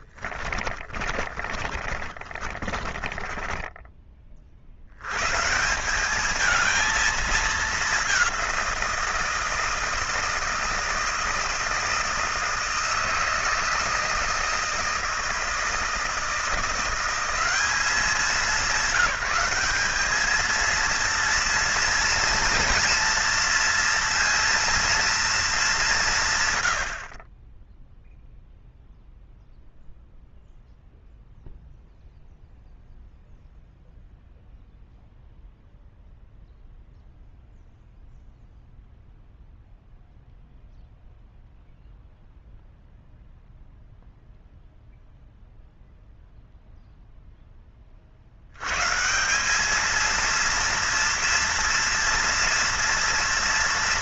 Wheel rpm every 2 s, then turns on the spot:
20, 20, 60, 220, 180, 160, 160, 160, 170, 190, 220, 230, 230, 110, 0, 0, 0, 0, 0, 0, 0, 0, 0, 0, 120, 230, 230.
0-4